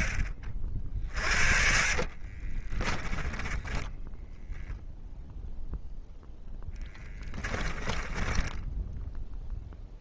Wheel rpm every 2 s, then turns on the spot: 50, 20, 0, 20, 0.
2-4 6-8